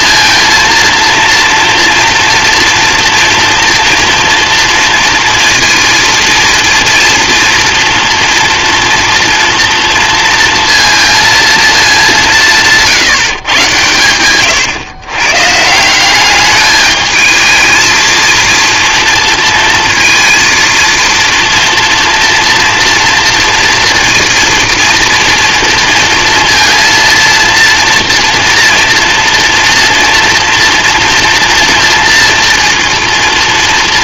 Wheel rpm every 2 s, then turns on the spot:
230, 230, 230, 230, 230, 230, 160, 120, 210, 230, 230, 230, 230, 230, 230, 230, 240.
none